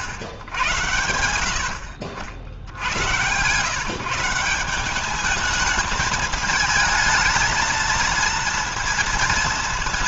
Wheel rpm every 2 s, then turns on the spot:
110, 80, 180, 220, 230.
none